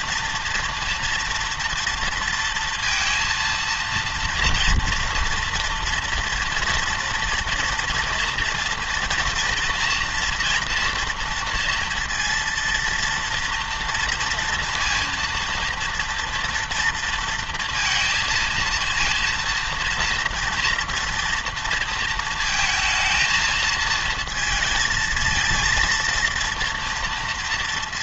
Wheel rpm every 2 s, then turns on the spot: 230, 230, 240, 230, 230, 230, 230, 230, 230, 230, 230, 230, 220, 230.
none